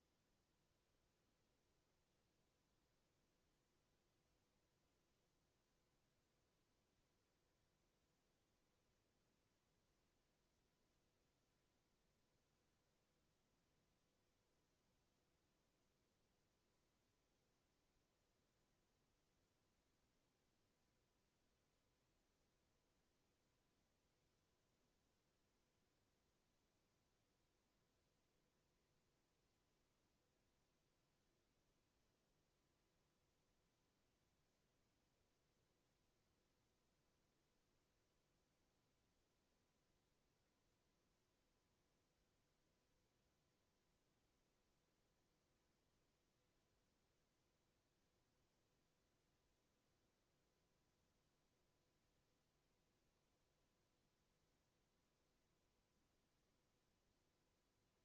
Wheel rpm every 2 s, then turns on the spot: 0, 0, 0, 0, 0, 0, 0, 0, 0, 0, 0, 0, 0, 0, 0, 0, 0, 0, 0, 0, 0, 0, 0, 0, 0, 0, 0, 0, 0.
none